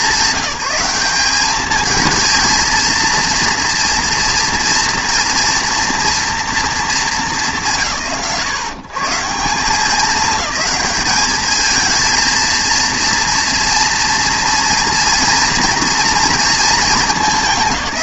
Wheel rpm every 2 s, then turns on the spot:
190, 230, 230, 230, 140, 210, 230, 230, 220.
none